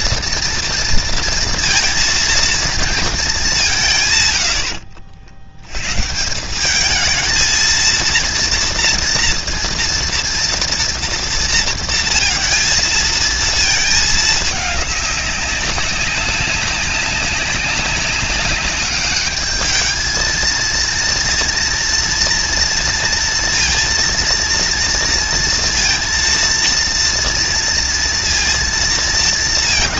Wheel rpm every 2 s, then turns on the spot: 230, 220, 80, 210, 230, 230, 230, 200, 200, 200, 230, 230, 230, 230, 230.
none